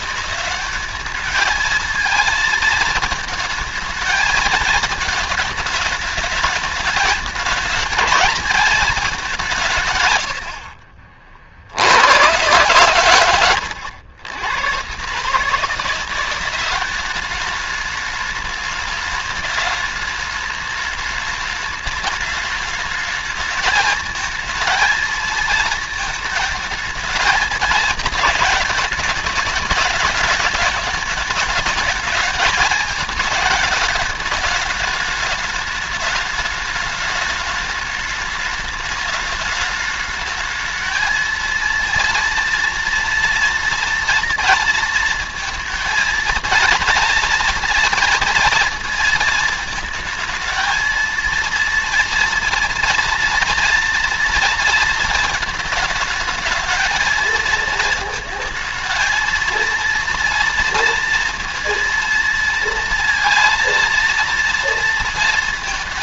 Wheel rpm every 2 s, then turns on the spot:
200, 220, 220, 210, 210, 30, 110, 130, 200, 210, 210, 210, 220, 220, 210, 210, 220, 210, 210, 210, 220, 230, 230, 230, 230, 230, 230, 230, 220, 220, 230, 230, 230.
none